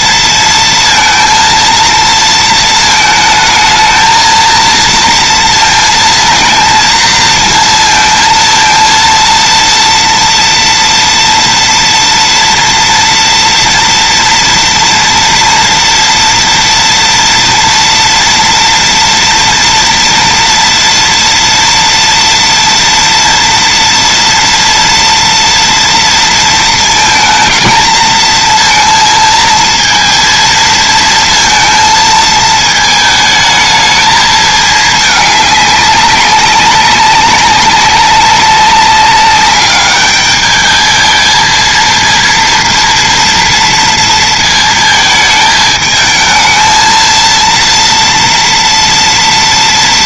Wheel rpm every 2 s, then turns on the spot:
230, 220, 230, 230, 230, 230, 230, 230, 230, 230, 230, 230, 230, 220, 230, 230, 220, 210, 190, 200, 220, 230, 220, 230, 230.
none